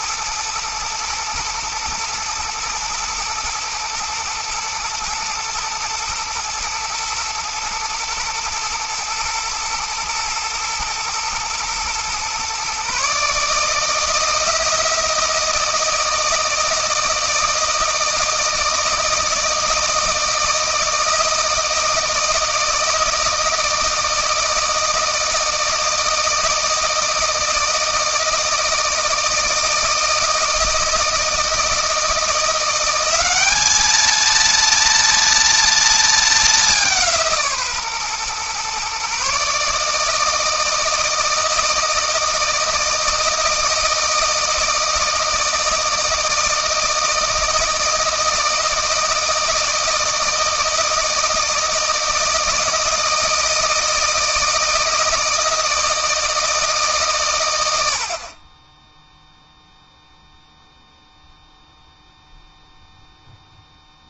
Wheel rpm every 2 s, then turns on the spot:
110, 120, 110, 120, 110, 110, 140, 170, 160, 160, 160, 160, 160, 160, 160, 160, 180, 230, 180, 130, 160, 160, 160, 160, 160, 160, 160, 160, 150, 10, 0, 0.
none